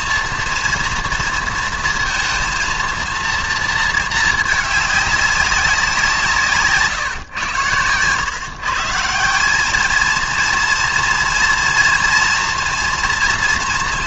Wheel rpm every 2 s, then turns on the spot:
230, 230, 210, 150, 150, 230, 230.
none